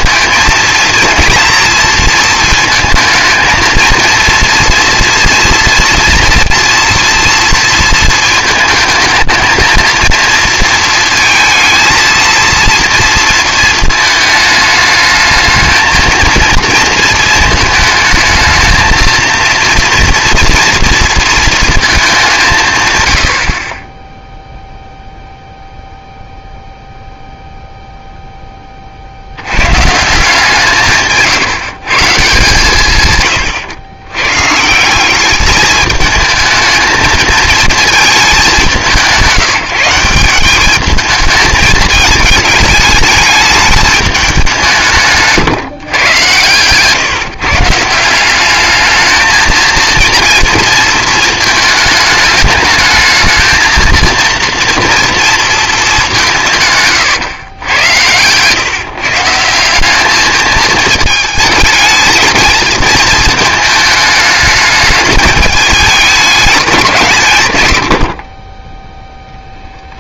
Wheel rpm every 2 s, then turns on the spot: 230, 220, 230, 240, 220, 230, 230, 210, 230, 220, 230, 120, 0, 0, 40, 160, 140, 160, 220, 190, 210, 220, 170, 130, 210, 230, 220, 230, 140, 150, 220, 220, 210, 200, 20.
68-70